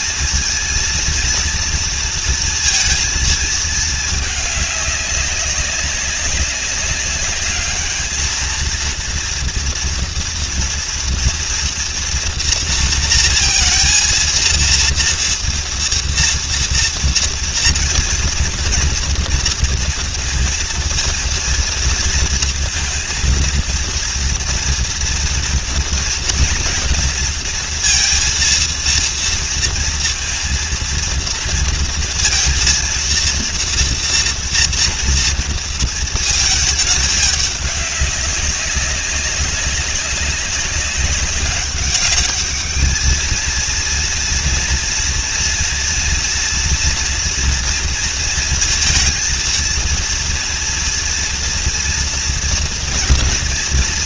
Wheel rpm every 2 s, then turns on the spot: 220, 230, 200, 200, 230, 230, 230, 230, 230, 240, 230, 230, 230, 230, 230, 230, 240, 230, 210, 190, 200, 210, 230, 230, 230, 230, 230.
none